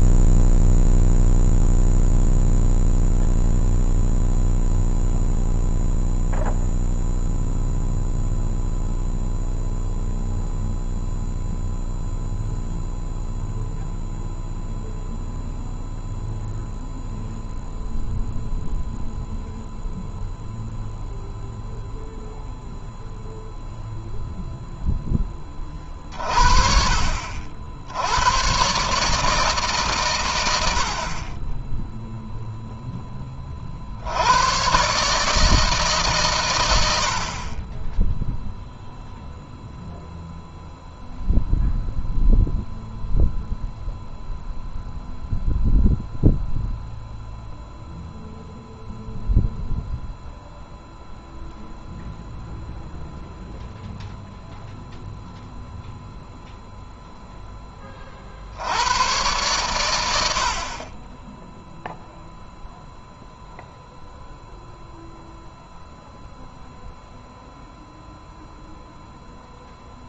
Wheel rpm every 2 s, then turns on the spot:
0, 0, 0, 0, 0, 0, 0, 0, 0, 0, 0, 0, 0, 40, 130, 70, 20, 140, 60, 0, 0, 0, 0, 0, 0, 0, 0, 0, 0, 90, 30, 0, 0, 0, 0.
none